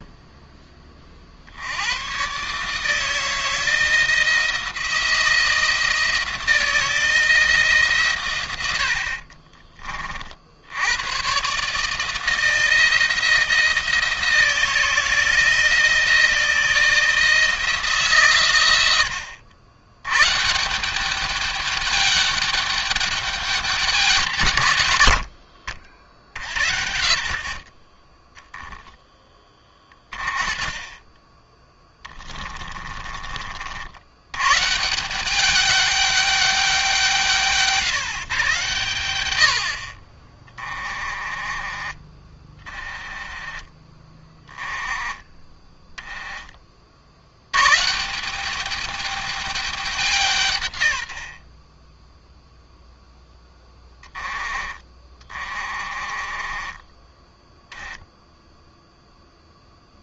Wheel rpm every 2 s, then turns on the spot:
20, 150, 170, 170, 90, 90, 160, 170, 160, 100, 150, 210, 120, 70, 10, 20, 20, 140, 190, 140, 40, 30, 20, 40, 200, 130, 0, 20, 30, 0.
28-30 32-34 40-42 44-46 54-58